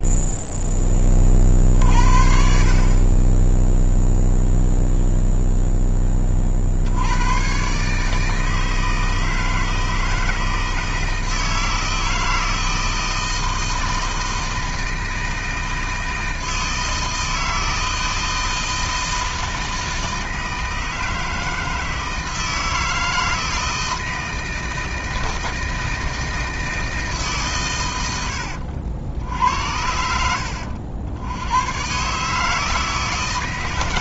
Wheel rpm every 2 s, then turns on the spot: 10, 50, 0, 70, 160, 160, 160, 160, 160, 160, 160, 160, 160, 160, 70, 70, 160.
none